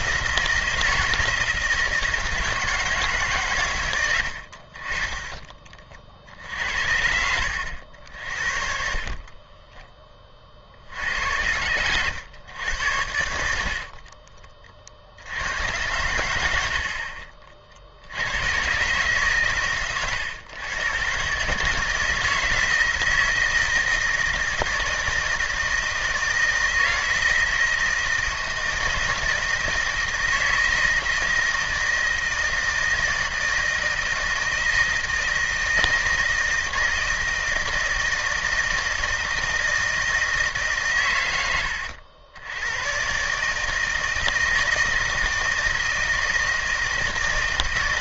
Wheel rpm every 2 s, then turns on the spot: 170, 160, 60, 60, 50, 50, 100, 30, 80, 110, 110, 160, 160, 170, 160, 160, 160, 160, 160, 160, 140, 100, 160, 160.
8-10